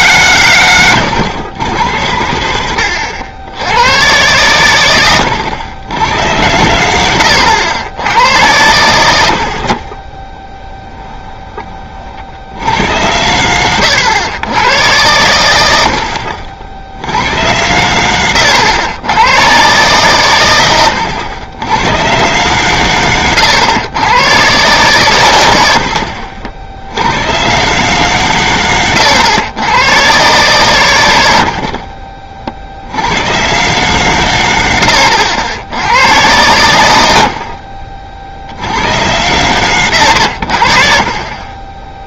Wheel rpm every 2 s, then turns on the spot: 120, 100, 110, 90, 90, 10, 90, 110, 50, 100, 110, 120, 120, 60, 120, 130, 60, 100, 100, 70, 70.
10-12 18-20